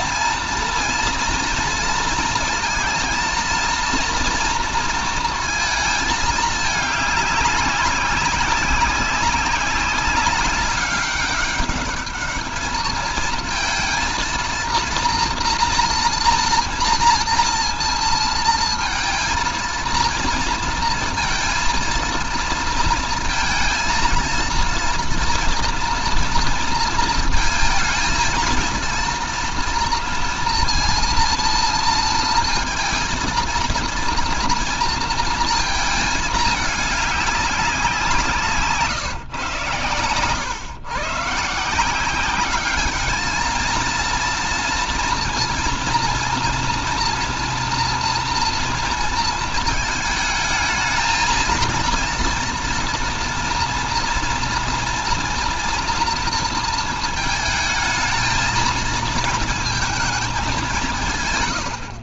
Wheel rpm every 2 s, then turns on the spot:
230, 230, 230, 210, 200, 200, 220, 230, 230, 230, 230, 230, 230, 230, 230, 230, 230, 230, 210, 160, 110, 210, 230, 230, 230, 220, 230, 240, 230, 220, 180.
none